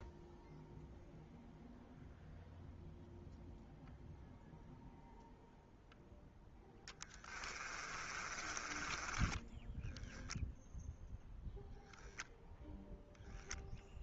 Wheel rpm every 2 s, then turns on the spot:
0, 0, 0, 10, 20, 0, 0.
8-10